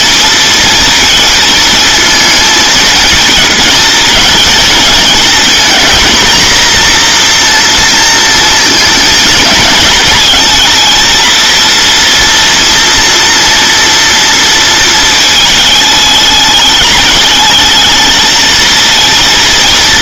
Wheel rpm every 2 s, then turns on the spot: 230, 220, 220, 240, 230, 230, 240, 230, 210, 230.
none